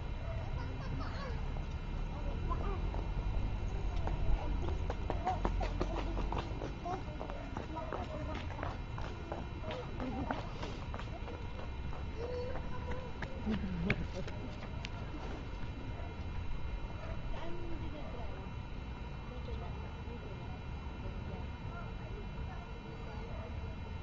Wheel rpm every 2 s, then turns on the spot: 0, 0, 0, 0, 0, 0, 0, 0, 0, 0, 0, 0.
none